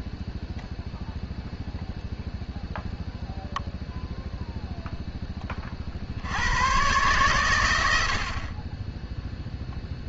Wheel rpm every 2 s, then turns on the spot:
0, 0, 0, 110, 10.
none